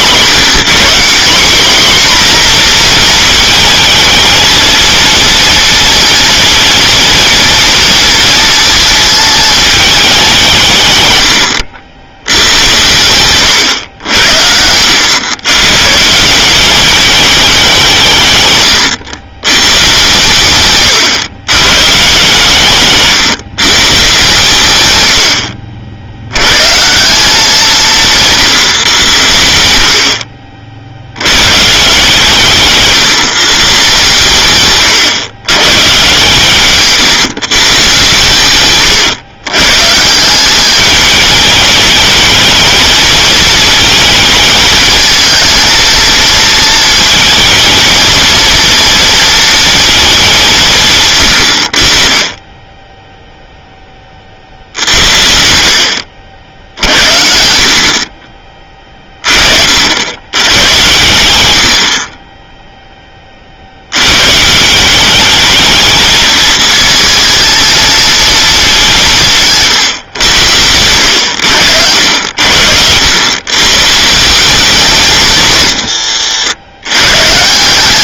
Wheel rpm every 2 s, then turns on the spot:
190, 240, 230, 230, 220, 150, 90, 90, 200, 110, 120, 140, 120, 150, 110, 70, 150, 120, 140, 120, 200, 220, 220, 230, 230, 140, 10, 80, 60, 30, 100, 10, 180, 220, 200, 90, 80, 190, 120.
12-14